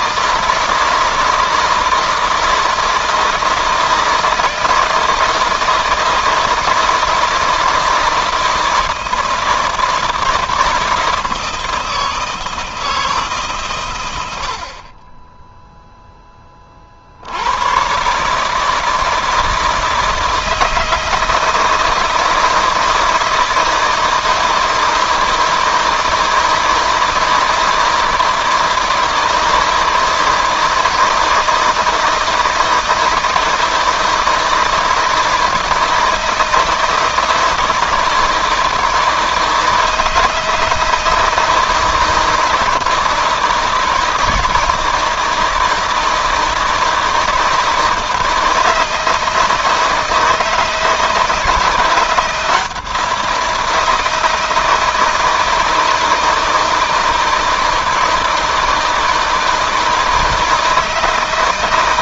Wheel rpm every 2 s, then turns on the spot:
160, 160, 160, 170, 160, 160, 160, 30, 60, 160, 160, 160, 160, 160, 160, 160, 160, 160, 160, 160, 160, 160, 160, 160, 160, 160, 170, 160, 160, 160, 160.
none